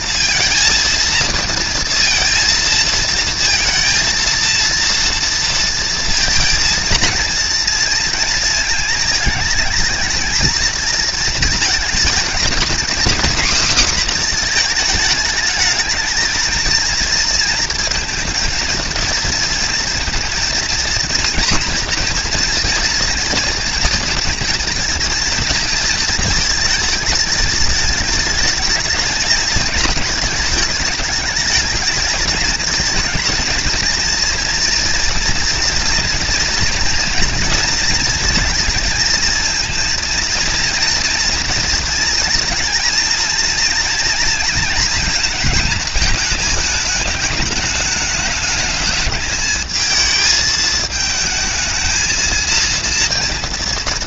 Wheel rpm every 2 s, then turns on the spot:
230, 230, 230, 230, 220, 230, 240, 220, 230, 230, 230, 240, 230, 220, 210, 210, 230, 240, 230, 220, 230, 230, 220, 220, 220, 220, 230.
none